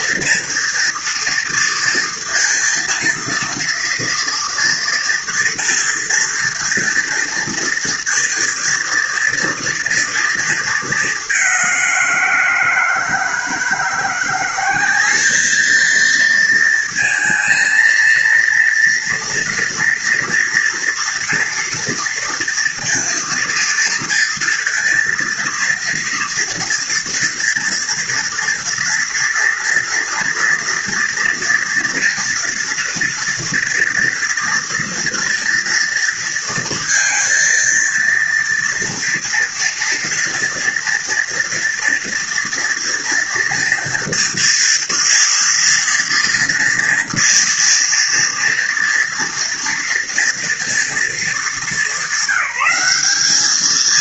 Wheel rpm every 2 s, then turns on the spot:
230, 230, 230, 230, 230, 220, 170, 180, 230, 230, 230, 230, 230, 230, 230, 230, 230, 230, 230, 230, 230, 230, 230, 230, 230, 230, 180.
none